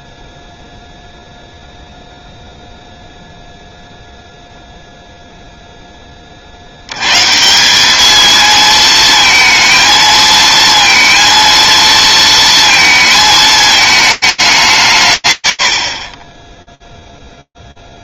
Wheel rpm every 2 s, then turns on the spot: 0, 0, 0, 160, 230, 230, 220, 110, 0.
none